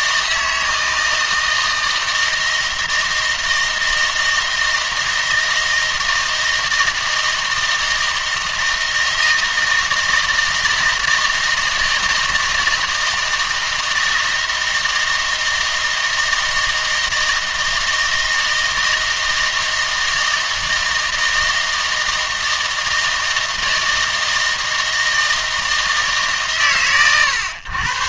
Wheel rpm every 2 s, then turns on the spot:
160, 160, 160, 160, 160, 160, 160, 160, 160, 160, 160, 160, 160, 120.
none